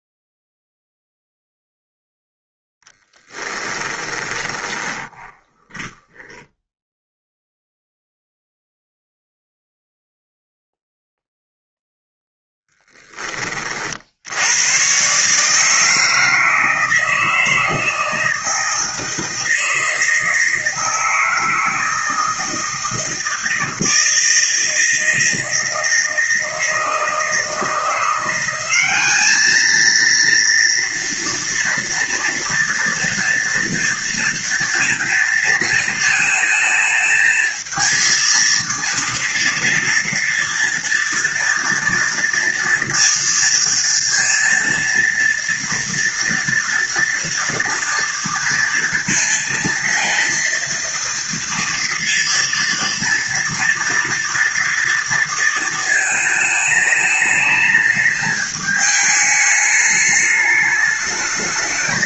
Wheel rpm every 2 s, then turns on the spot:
0, 10, 20, 0, 0, 0, 10, 120, 160, 160, 160, 160, 160, 160, 200, 230, 240, 230, 220, 230, 240, 230, 230, 230, 230, 230, 230, 230, 210, 210, 210.
2-6